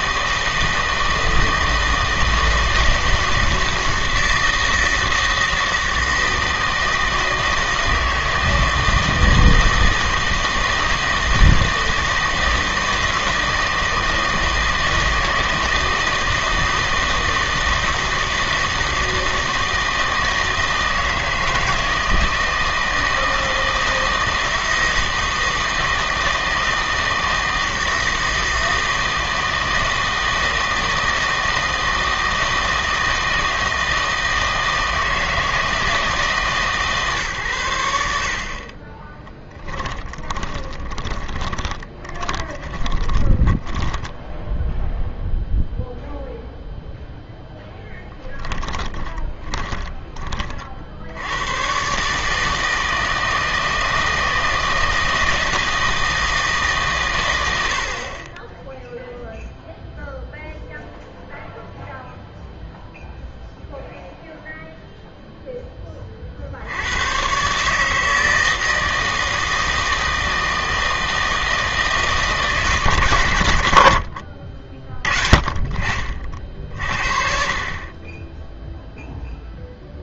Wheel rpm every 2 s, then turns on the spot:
160, 160, 160, 160, 160, 160, 160, 160, 160, 160, 160, 160, 160, 160, 160, 160, 160, 160, 140, 30, 20, 20, 0, 0, 10, 60, 160, 160, 150, 10, 0, 0, 0, 70, 160, 160, 160, 40, 40, 0.
38-44 48-50